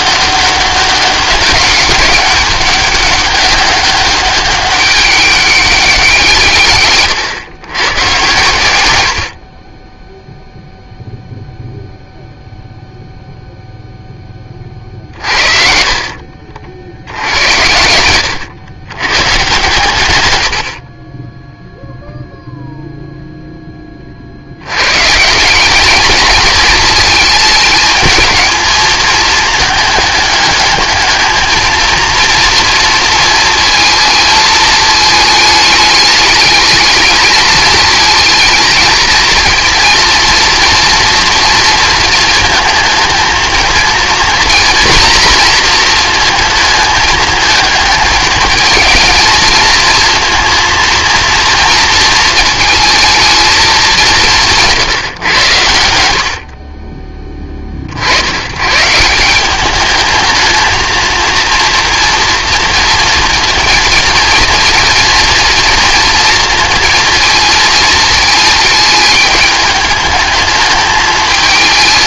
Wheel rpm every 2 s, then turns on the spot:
200, 200, 200, 130, 90, 0, 0, 40, 60, 110, 40, 0, 150, 220, 220, 220, 230, 220, 220, 220, 230, 220, 230, 220, 220, 230, 220, 150, 20, 150, 220, 230, 230, 230, 210, 220.
14-16